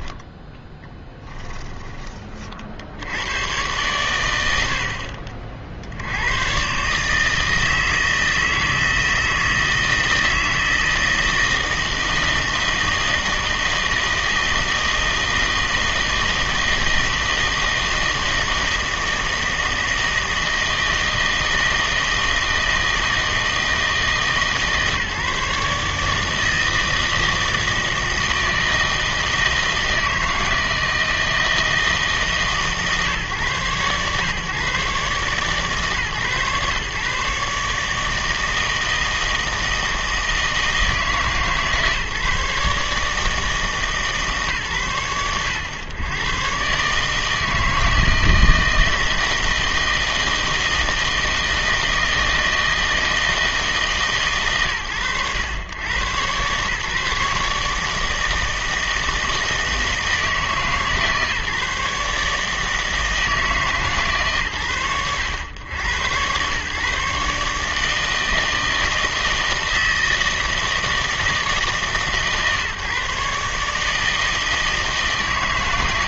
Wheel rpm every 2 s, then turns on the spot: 10, 50, 90, 130, 160, 160, 160, 160, 160, 160, 160, 160, 150, 160, 160, 160, 150, 130, 140, 160, 160, 150, 130, 140, 160, 160, 160, 120, 130, 160, 150, 160, 100, 130, 160, 160, 140, 160.
0-2